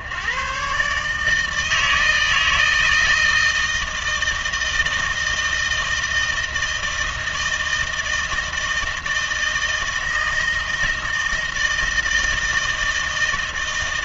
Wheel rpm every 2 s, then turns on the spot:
130, 160, 160, 160, 160, 160, 160.
none